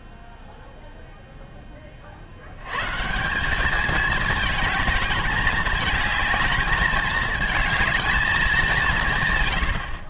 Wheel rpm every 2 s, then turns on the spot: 0, 170, 210, 210, 130.
none